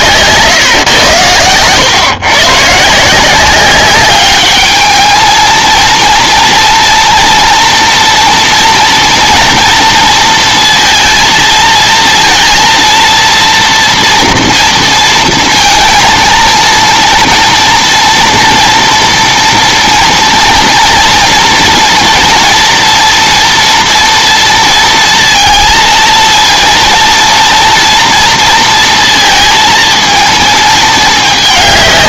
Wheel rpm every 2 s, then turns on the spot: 130, 140, 210, 230, 230, 230, 230, 230, 220, 230, 230, 230, 230, 230, 230, 220.
none